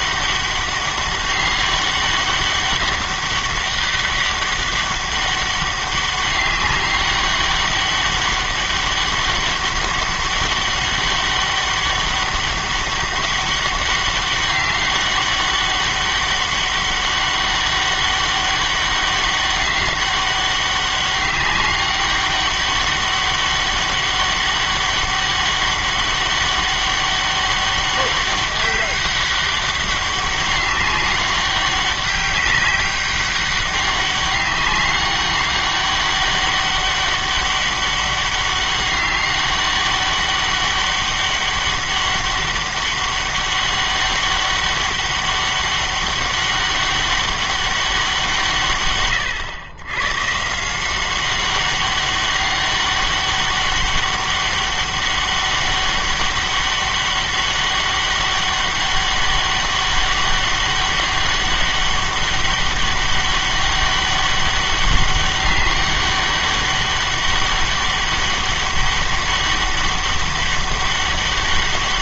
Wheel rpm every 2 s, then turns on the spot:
200, 190, 200, 200, 200, 200, 200, 200, 200, 200, 200, 200, 200, 200, 200, 200, 200, 200, 200, 200, 200, 200, 200, 200, 140, 160, 200, 200, 200, 200, 200, 200, 200, 200, 200, 200.
none